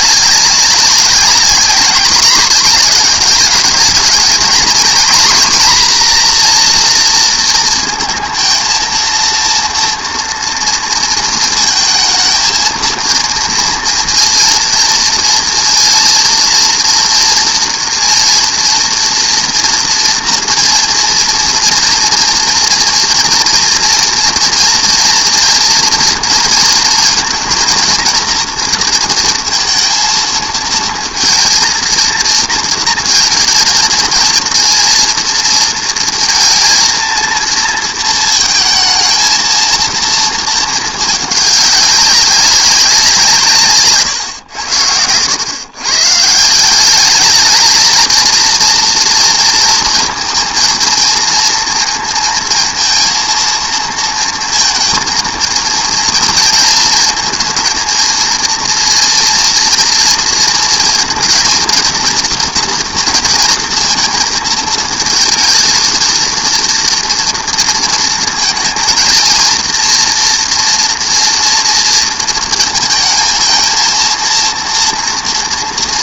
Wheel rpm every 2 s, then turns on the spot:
200, 210, 230, 240, 230, 230, 230, 230, 230, 230, 230, 230, 230, 230, 230, 220, 230, 230, 230, 220, 220, 200, 100, 170, 230, 220, 230, 230, 230, 230, 230, 230, 220, 230, 230, 230, 220, 230.
none